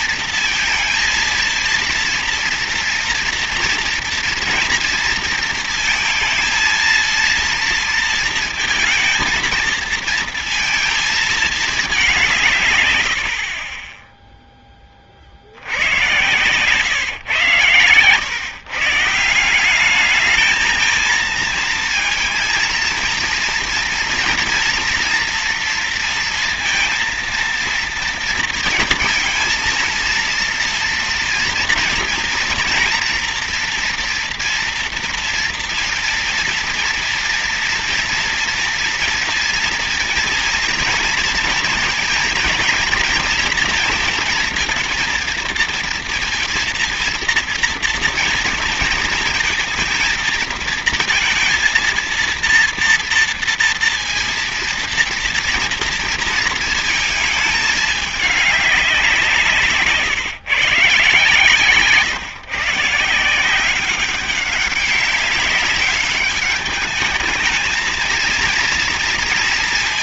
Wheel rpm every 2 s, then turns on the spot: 230, 230, 240, 230, 230, 220, 150, 10, 130, 140, 220, 230, 230, 230, 230, 230, 230, 230, 230, 230, 230, 230, 230, 230, 230, 230, 230, 230, 230, 200, 140, 140, 200, 200, 230.
none